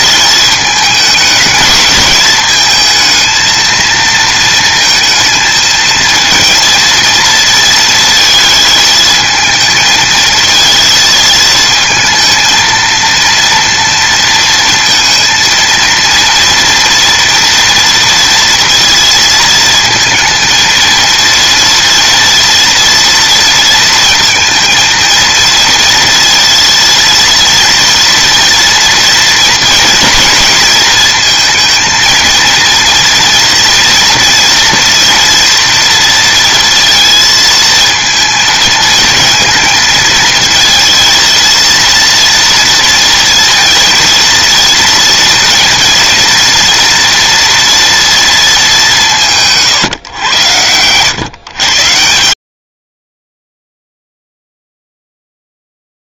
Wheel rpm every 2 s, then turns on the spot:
220, 220, 230, 230, 230, 220, 230, 230, 230, 230, 230, 230, 230, 230, 230, 220, 230, 230, 230, 220, 230, 230, 230, 230, 200, 100, 90, 0.
none